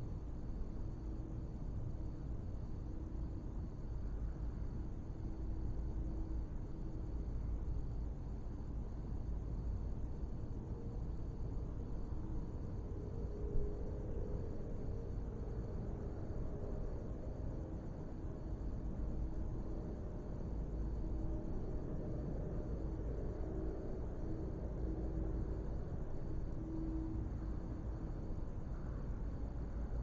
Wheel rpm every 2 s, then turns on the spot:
0, 0, 0, 0, 0, 0, 0, 0, 0, 0, 0, 0, 0, 0, 0.
none